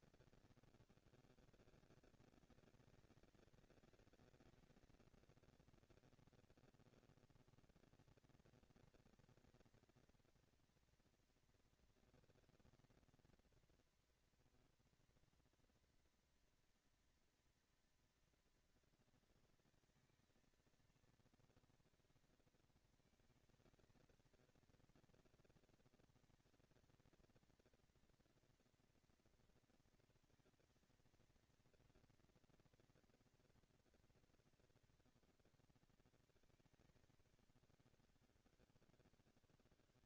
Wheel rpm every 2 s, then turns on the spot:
180, 220, 220, 120, 210, 220, 230, 230, 220, 230, 230, 220, 230, 230, 240, 230, 230, 200, 200, 180.
none